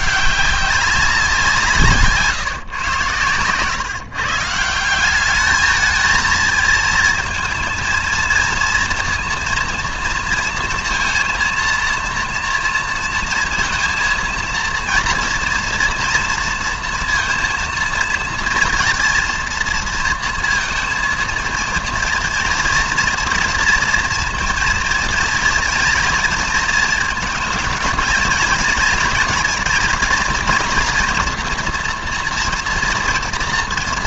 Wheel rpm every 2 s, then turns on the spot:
190, 140, 160, 230, 230, 230, 230, 230, 230, 230, 230, 240, 230, 230, 220, 230, 230.
none